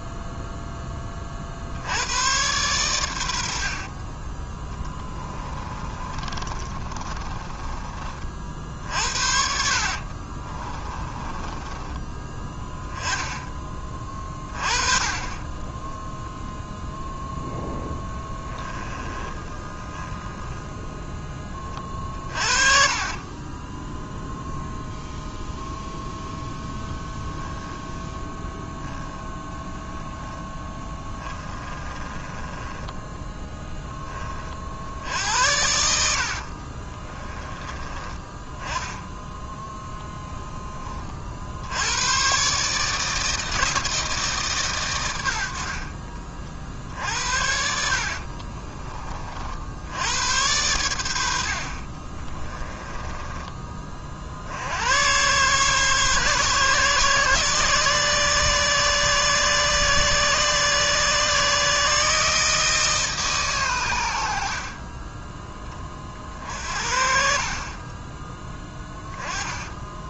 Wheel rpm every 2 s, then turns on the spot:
20, 100, 10, 30, 60, 20, 10, 20, 10, 20, 10, 30, 0, 0, 10, 20, 10, 70, 30, 10, 30, 150, 110, 60, 30, 80, 20, 100, 140, 140, 140, 150, 30, 50, 10.
4-8 10-12 18-20 22-24 30-34 36-38 46-48 52-54 68-70